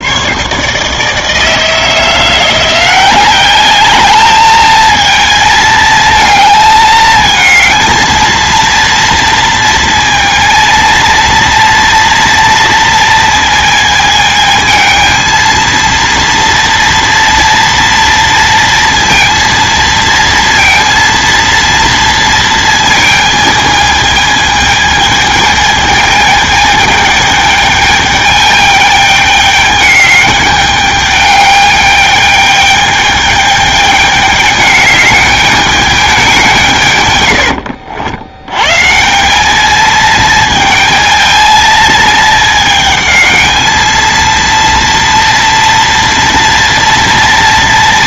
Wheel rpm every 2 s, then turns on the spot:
150, 180, 220, 220, 230, 230, 230, 220, 230, 230, 230, 220, 220, 210, 210, 210, 210, 200, 150, 140, 220, 220, 230, 230.
none